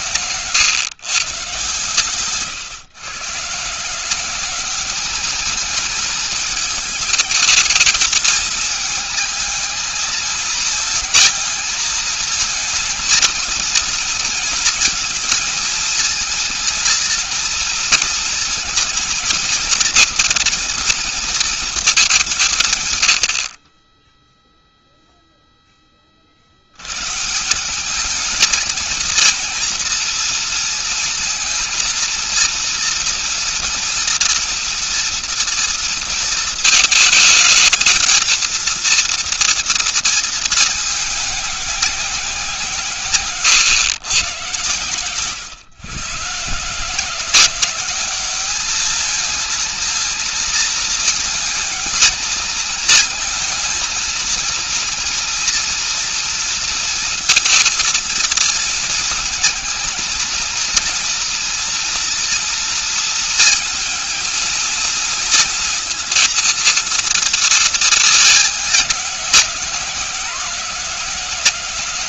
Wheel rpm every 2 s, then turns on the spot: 120, 180, 220, 220, 220, 220, 230, 230, 220, 230, 190, 10, 20, 200, 230, 230, 230, 230, 220, 230, 190, 120, 130, 190, 230, 220, 230, 230, 230, 230, 230, 230, 230, 220, 180, 150.
none